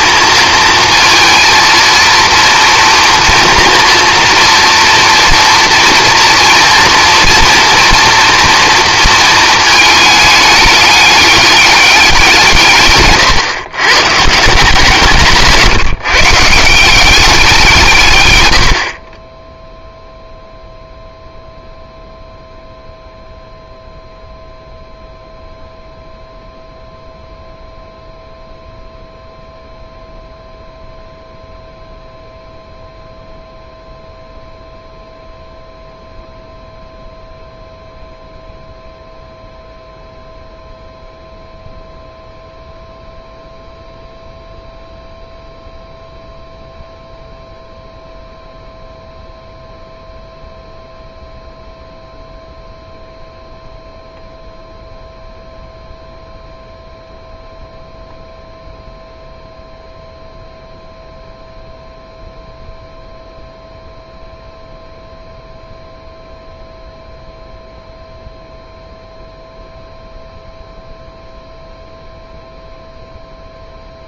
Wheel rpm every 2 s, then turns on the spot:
230, 230, 230, 230, 230, 200, 140, 160, 180, 70, 0, 0, 0, 0, 0, 0, 0, 0, 0, 0, 0, 0, 0, 0, 0, 0, 0, 0, 0, 0, 0, 0, 0, 0, 0, 0, 0.
none